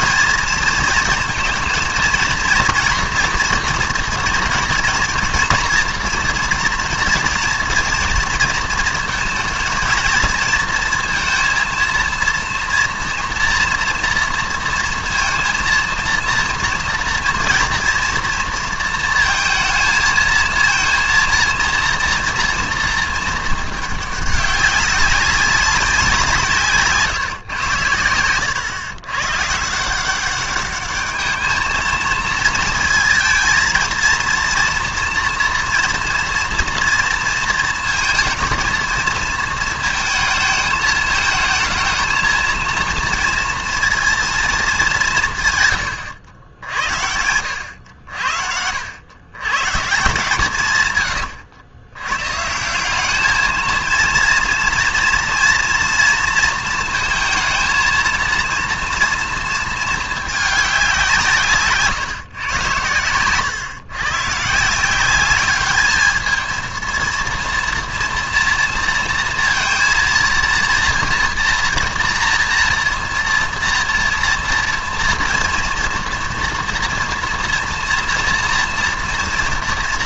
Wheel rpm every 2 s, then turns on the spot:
230, 240, 230, 230, 230, 230, 230, 230, 230, 230, 230, 230, 200, 150, 120, 200, 230, 230, 230, 230, 220, 230, 210, 70, 70, 130, 170, 230, 230, 230, 200, 110, 160, 230, 230, 230, 230, 240, 230, 230.
none